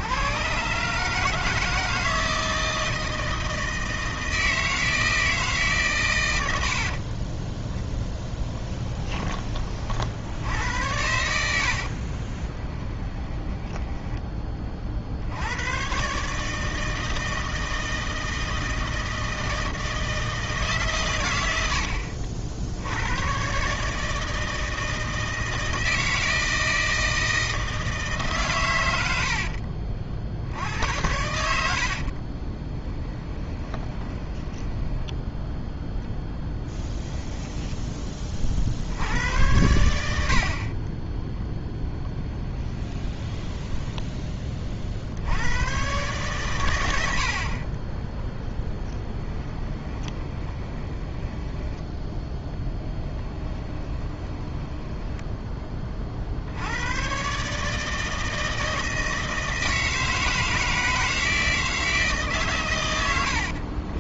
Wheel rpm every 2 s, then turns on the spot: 140, 160, 160, 60, 10, 90, 20, 40, 160, 160, 140, 80, 160, 160, 100, 80, 10, 10, 10, 70, 20, 20, 50, 100, 20, 20, 10, 10, 100, 160, 160, 110.
6-10 12-14 32-38 42-44 48-56